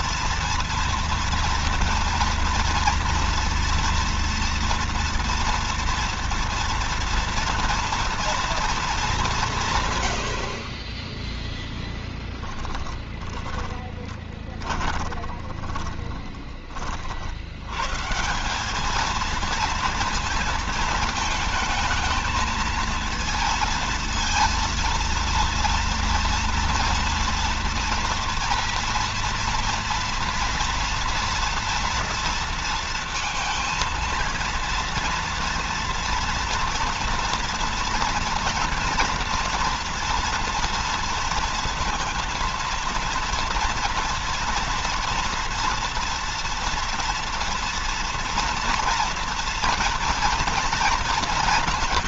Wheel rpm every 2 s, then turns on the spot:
230, 230, 240, 230, 220, 30, 20, 30, 40, 210, 220, 220, 230, 230, 230, 240, 230, 230, 240, 230, 230, 230, 230, 230, 230, 230.
12-16